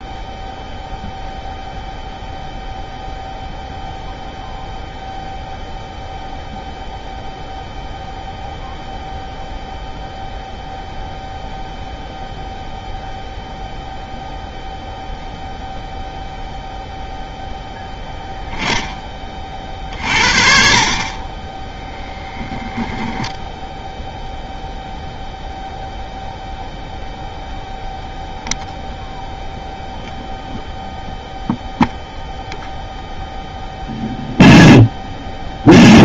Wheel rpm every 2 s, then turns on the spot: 0, 0, 0, 0, 0, 0, 0, 0, 0, 0, 40, 10, 0, 0, 0, 0, 0, 0.
22-24